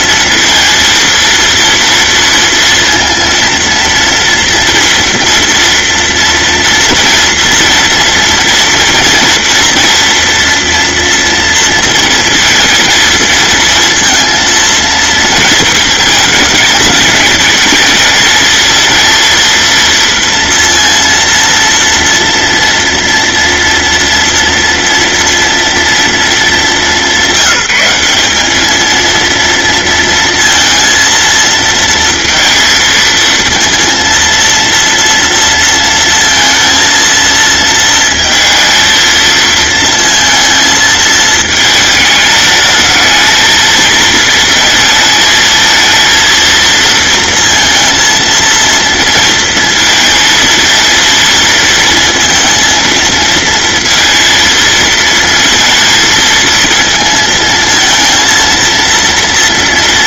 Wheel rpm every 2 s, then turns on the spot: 230, 230, 230, 230, 230, 230, 230, 230, 220, 220, 230, 230, 230, 210, 220, 230, 230, 230, 230, 230, 220, 220, 220, 230, 230, 230, 230, 230, 220, 230.
none